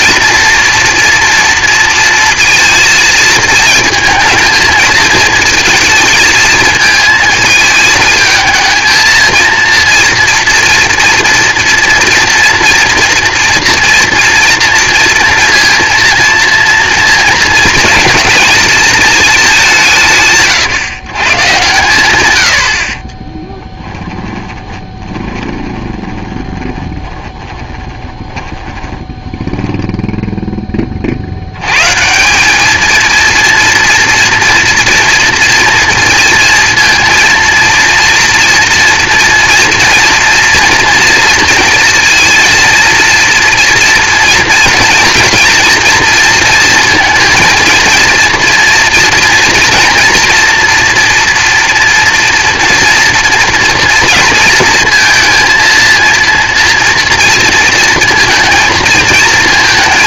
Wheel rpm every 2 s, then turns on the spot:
230, 230, 220, 220, 220, 240, 230, 230, 230, 220, 150, 50, 30, 30, 20, 20, 210, 230, 230, 230, 230, 230, 230, 230, 230, 240, 240, 230, 230, 230.
24-30